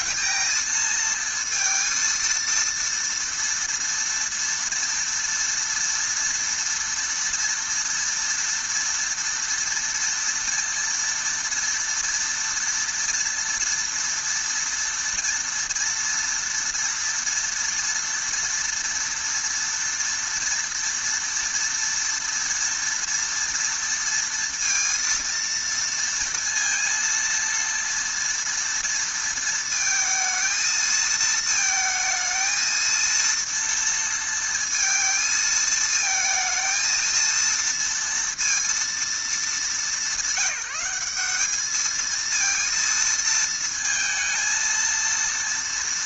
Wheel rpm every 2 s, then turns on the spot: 230, 230, 230, 230, 230, 230, 230, 230, 230, 230, 230, 230, 230, 230, 230, 220, 230, 230, 230, 220, 190, 230, 230.
none